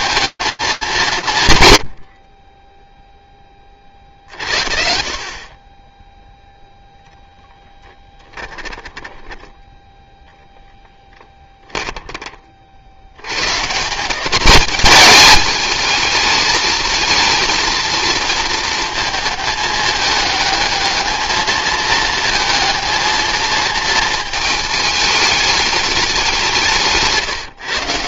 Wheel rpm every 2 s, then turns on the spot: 220, 40, 50, 0, 10, 10, 100, 210, 220, 220, 220, 220, 210, 160.
8-12